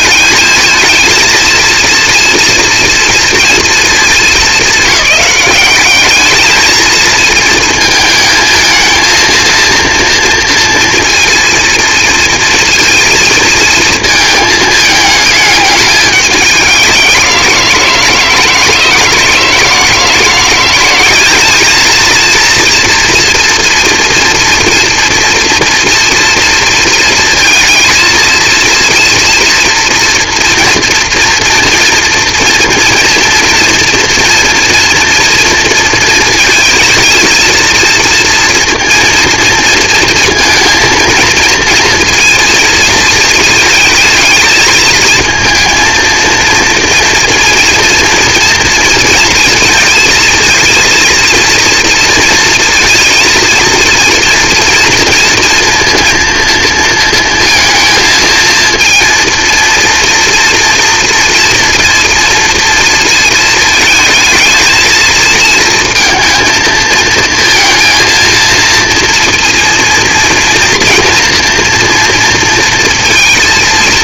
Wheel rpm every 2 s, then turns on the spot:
220, 230, 220, 220, 220, 230, 230, 220, 200, 160, 180, 230, 230, 230, 230, 230, 240, 230, 220, 230, 230, 230, 220, 230, 230, 230, 230, 230, 230, 230, 240, 230, 220, 230, 230, 230, 230.
none